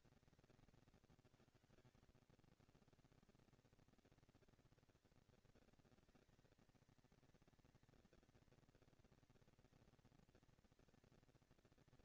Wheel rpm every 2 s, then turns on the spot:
170, 120, 230, 220, 230, 230.
none